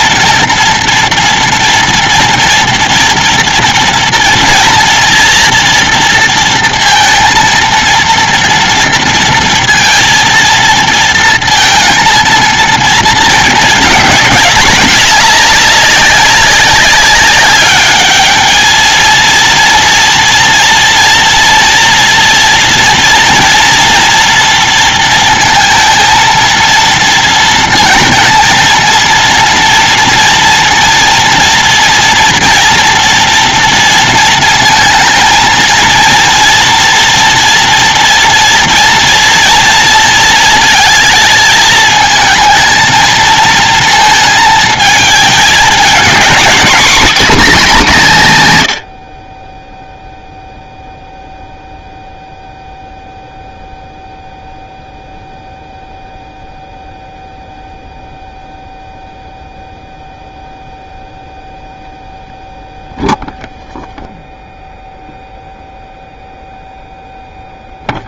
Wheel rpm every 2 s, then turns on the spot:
230, 230, 230, 230, 230, 230, 230, 210, 200, 210, 230, 230, 230, 230, 230, 230, 240, 230, 230, 230, 230, 220, 230, 210, 170, 0, 0, 0, 0, 0, 0, 0, 0, 0.
none